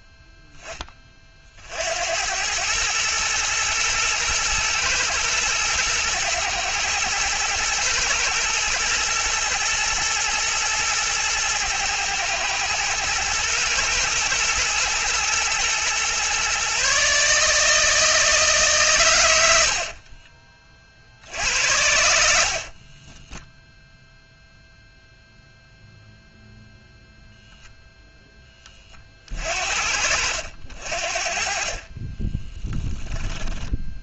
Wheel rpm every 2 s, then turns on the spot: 20, 110, 110, 120, 110, 120, 110, 120, 140, 130, 40, 40, 0, 0, 30, 60, 10.
22-24 32-34